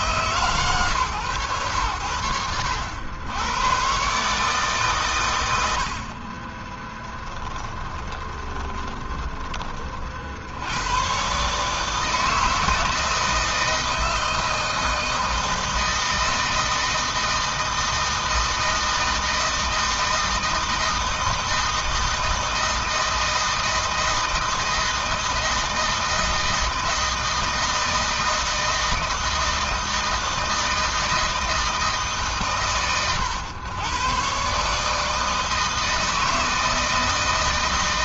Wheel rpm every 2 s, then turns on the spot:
150, 90, 140, 30, 20, 80, 160, 160, 160, 160, 160, 160, 160, 160, 160, 160, 140, 140, 160.
8-10